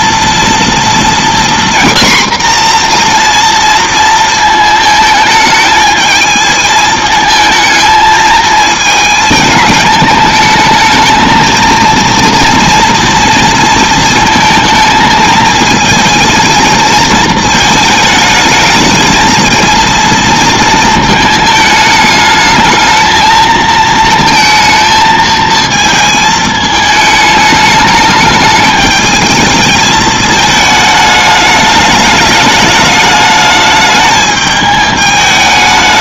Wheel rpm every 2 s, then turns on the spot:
230, 250, 220, 220, 220, 220, 230, 230, 230, 220, 230, 210, 230, 220, 210, 220, 210, 210.
none